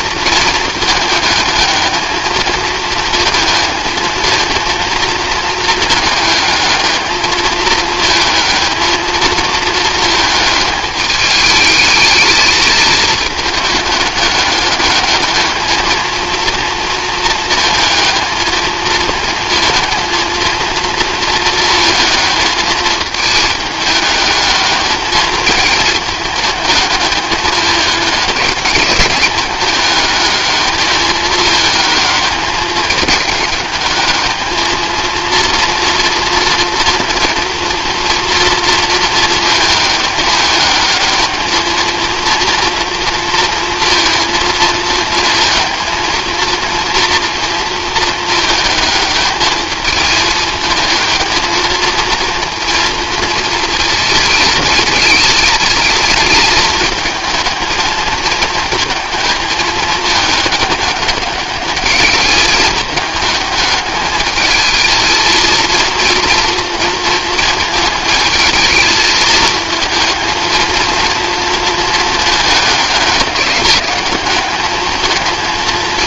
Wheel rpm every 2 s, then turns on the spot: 220, 220, 230, 210, 220, 220, 220, 200, 230, 220, 230, 220, 220, 220, 200, 210, 210, 220, 230, 230, 210, 230, 230, 230, 220, 220, 230, 220, 220, 220, 200, 210, 220, 230, 220, 230, 210, 210.
none